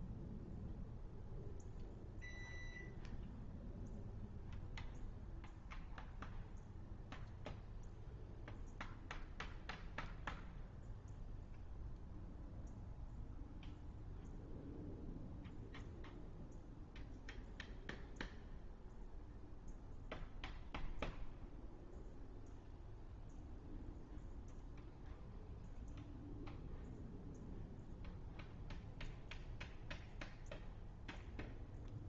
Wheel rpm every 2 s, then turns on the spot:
0, 0, 0, 0, 0, 0, 0, 0, 0, 0, 0, 0, 0, 0, 0, 0.
none